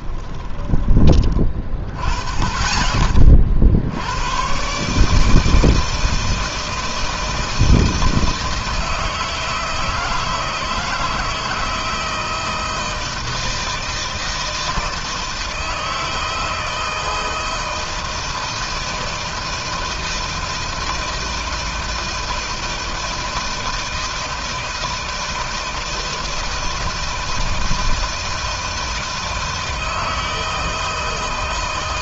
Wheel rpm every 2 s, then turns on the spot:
20, 40, 140, 160, 160, 160, 160, 160, 160, 160, 160, 160, 160, 160, 160, 160.
none